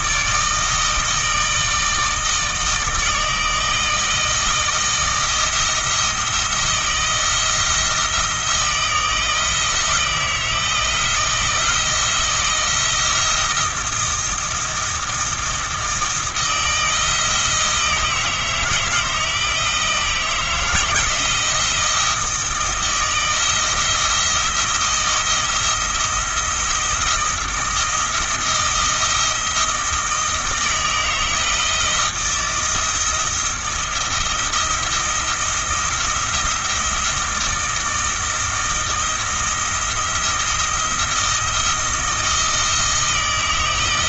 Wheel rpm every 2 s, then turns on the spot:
160, 160, 160, 160, 160, 160, 160, 170, 160, 160, 170, 160, 170, 160, 170, 160, 170, 170, 160, 160, 170, 160.
none